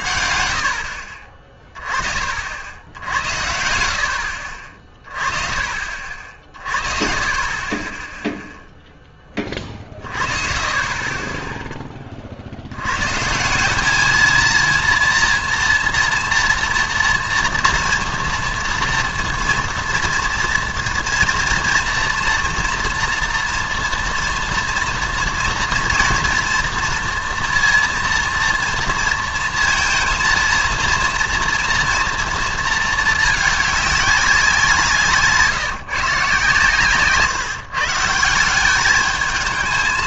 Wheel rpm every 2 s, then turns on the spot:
70, 60, 40, 50, 0, 30, 80, 230, 230, 230, 240, 240, 240, 230, 230, 230, 220, 180, 140, 190.
none